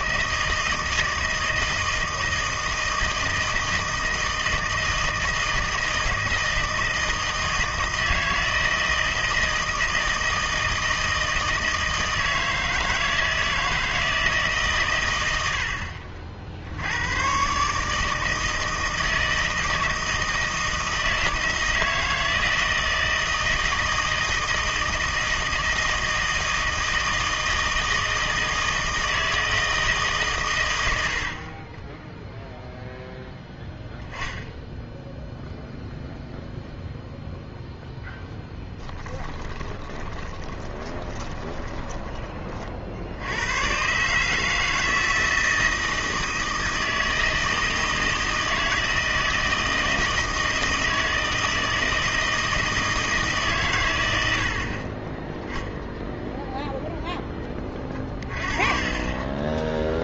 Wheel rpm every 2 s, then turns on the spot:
160, 160, 160, 160, 160, 160, 160, 150, 70, 160, 160, 160, 160, 160, 160, 110, 0, 0, 0, 10, 20, 40, 160, 160, 160, 160, 160, 50, 0, 30.
38-42